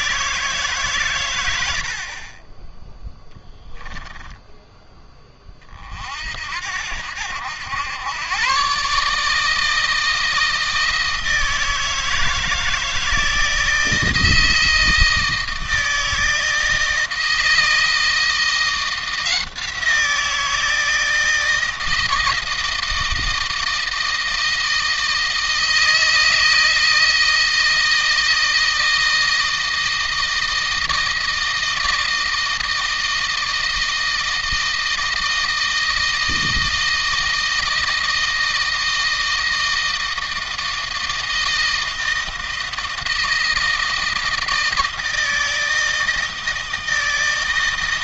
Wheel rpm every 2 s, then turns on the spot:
120, 10, 10, 80, 140, 160, 160, 160, 160, 170, 160, 160, 160, 160, 160, 160, 160, 160, 160, 160, 160, 160, 160, 160.
none